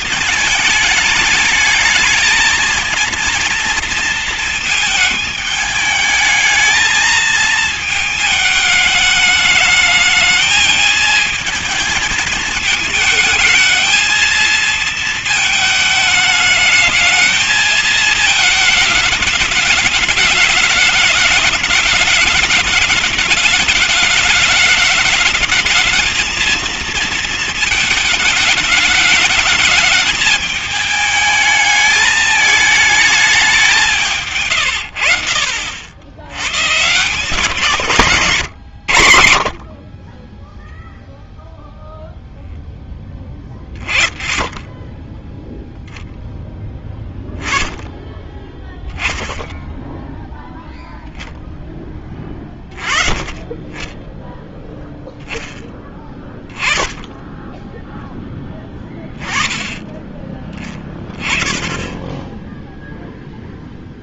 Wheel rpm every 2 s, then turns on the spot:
210, 220, 230, 210, 220, 220, 210, 230, 220, 220, 210, 220, 210, 220, 210, 210, 210, 110, 120, 120, 10, 0, 10, 0, 10, 0, 20, 10, 10, 10, 20, 10.
none